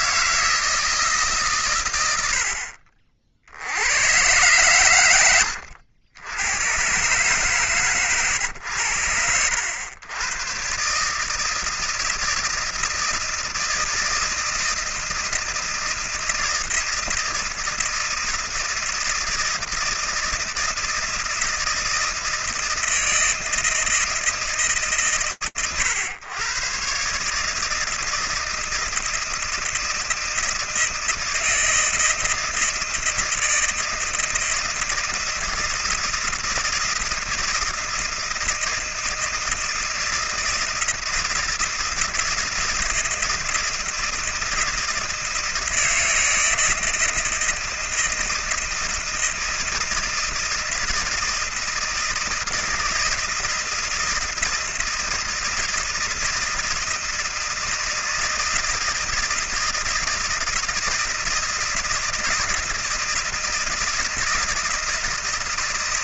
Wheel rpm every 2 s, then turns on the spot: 160, 50, 120, 110, 100, 120, 160, 160, 160, 160, 160, 160, 140, 130, 160, 160, 160, 160, 160, 160, 160, 160, 160, 160, 160, 160, 160, 160, 160, 170, 170, 160, 160.
none